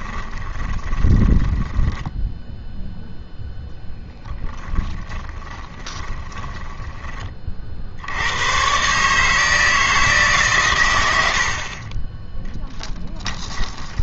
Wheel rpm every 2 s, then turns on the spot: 20, 0, 10, 20, 110, 120, 10.
0-2 4-8